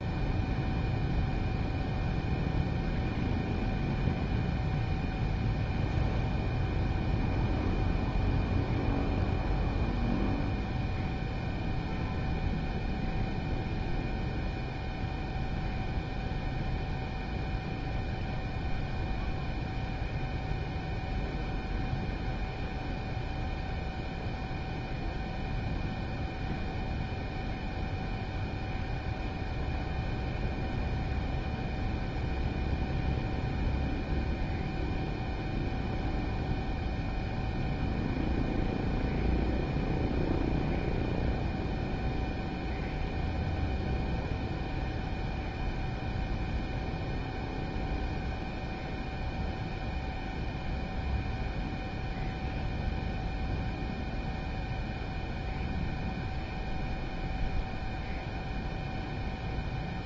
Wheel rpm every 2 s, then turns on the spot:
0, 0, 0, 0, 0, 0, 0, 0, 0, 0, 0, 0, 0, 0, 0, 0, 0, 0, 0, 0, 0, 0, 0, 0, 0, 0, 0, 0, 0, 0.
none